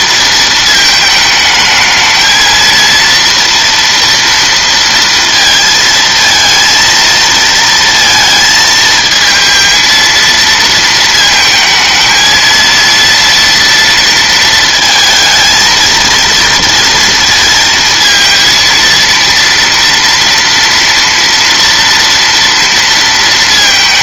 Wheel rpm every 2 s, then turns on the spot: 220, 230, 230, 230, 220, 230, 230, 220, 230, 230, 230, 230.
none